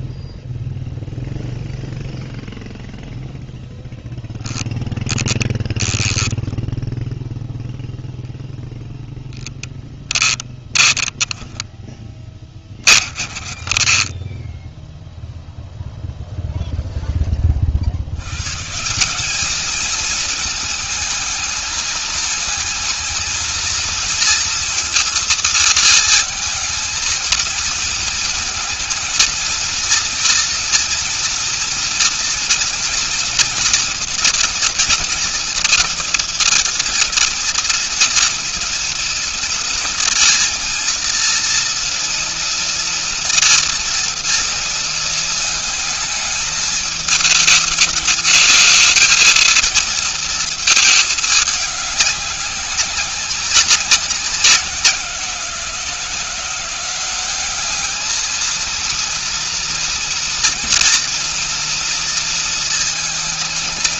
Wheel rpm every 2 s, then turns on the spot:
0, 0, 0, 20, 10, 20, 0, 10, 170, 220, 230, 230, 230, 230, 230, 230, 230, 230, 230, 230, 240, 220, 220, 220, 220, 190, 180, 190, 230, 240, 230, 230.
6-12